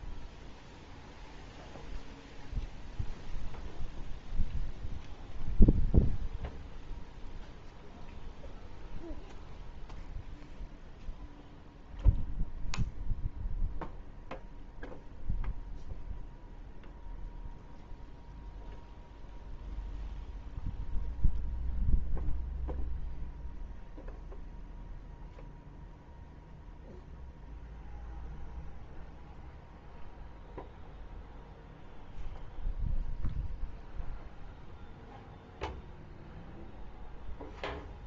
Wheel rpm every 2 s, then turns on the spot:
0, 0, 0, 0, 0, 0, 0, 0, 0, 0, 0, 0, 0, 0, 0, 0, 0, 0, 0.
none